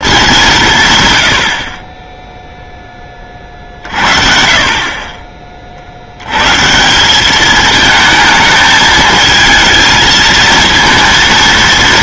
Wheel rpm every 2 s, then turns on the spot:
140, 10, 40, 170, 220, 230.
none